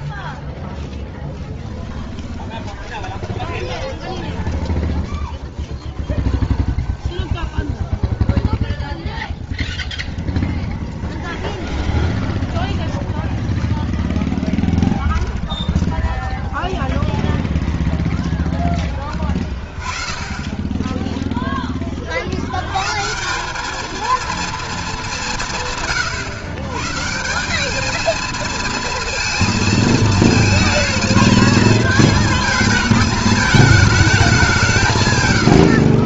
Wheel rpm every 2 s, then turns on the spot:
0, 20, 10, 0, 0, 10, 10, 10, 0, 20, 20, 90, 220, 120, 220, 220, 220, 180.
2-6 10-16